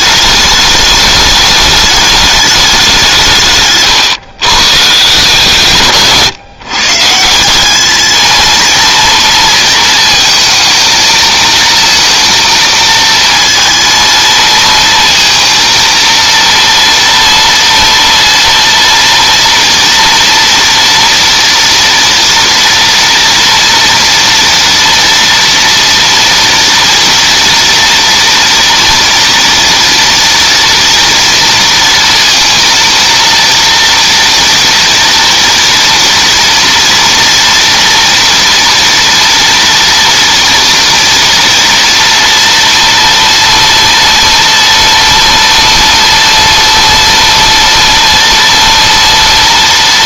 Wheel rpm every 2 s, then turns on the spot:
210, 210, 140, 140, 220, 230, 230, 230, 230, 230, 230, 230, 230, 230, 230, 230, 230, 240, 230, 230, 230, 230, 230, 230, 230.
6-8